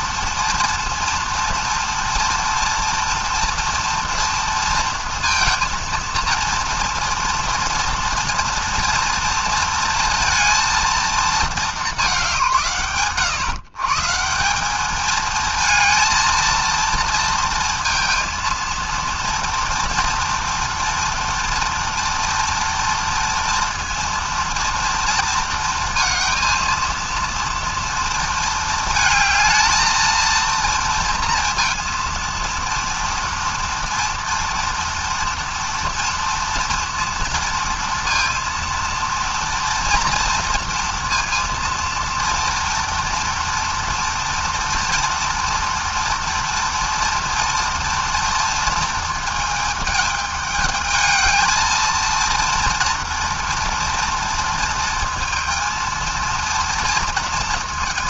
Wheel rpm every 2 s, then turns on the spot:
240, 240, 230, 240, 230, 220, 110, 220, 230, 230, 230, 240, 230, 230, 220, 230, 240, 230, 230, 240, 230, 230, 230, 230, 220, 220, 240, 230, 230.
none